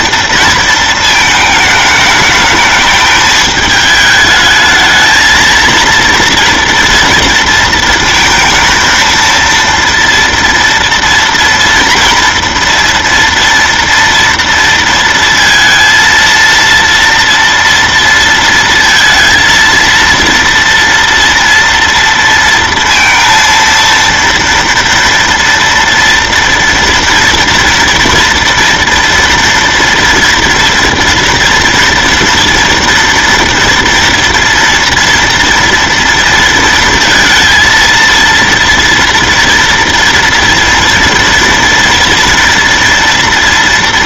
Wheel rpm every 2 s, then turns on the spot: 220, 210, 220, 230, 230, 230, 230, 230, 230, 230, 230, 230, 230, 240, 230, 230, 230, 230, 230, 230, 230, 230.
none